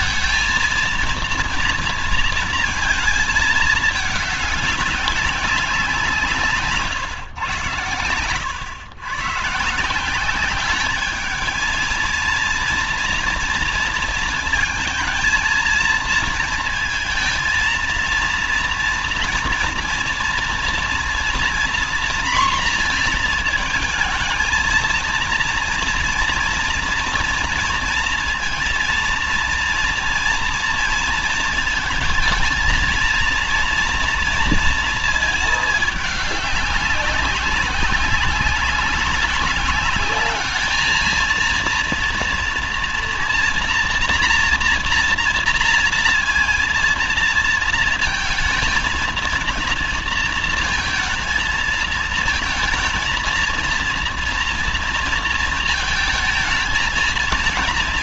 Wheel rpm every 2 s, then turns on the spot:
230, 230, 200, 150, 110, 200, 230, 230, 230, 230, 230, 240, 230, 230, 230, 230, 220, 230, 200, 190, 210, 230, 240, 230, 230, 230, 220, 230, 220.
none